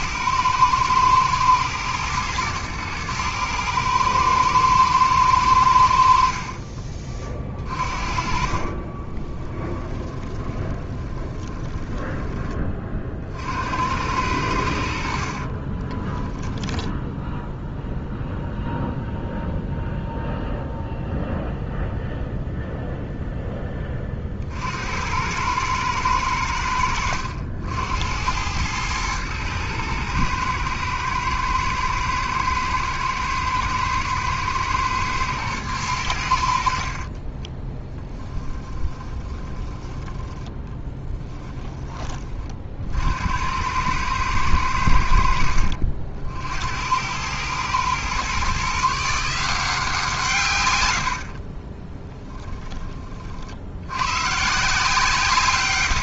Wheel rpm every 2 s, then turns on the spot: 110, 110, 110, 40, 30, 20, 30, 70, 10, 0, 0, 0, 70, 90, 110, 120, 120, 110, 60, 20, 10, 50, 90, 80, 150, 120, 20, 160.
6-12 36-42 50-52